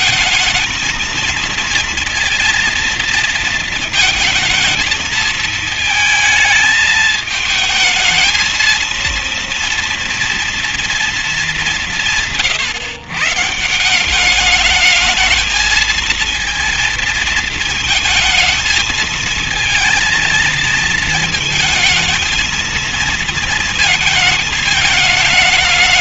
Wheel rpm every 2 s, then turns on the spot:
230, 230, 230, 220, 220, 230, 150, 200, 230, 220, 230, 230, 220.
none